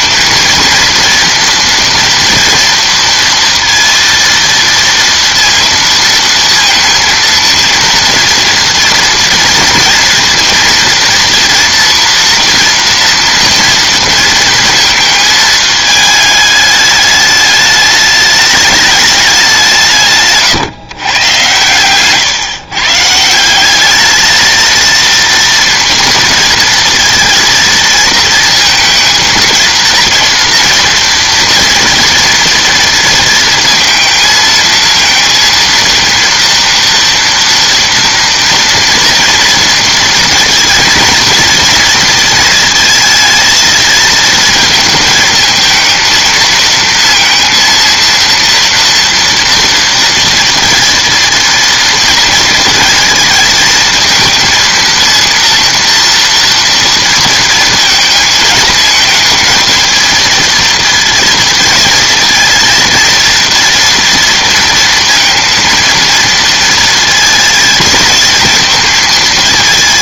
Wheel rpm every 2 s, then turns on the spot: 230, 230, 230, 230, 230, 230, 230, 230, 210, 210, 140, 130, 220, 230, 230, 230, 230, 230, 230, 230, 230, 230, 220, 230, 240, 230, 230, 230, 230, 230, 220, 230, 230, 230, 220.
none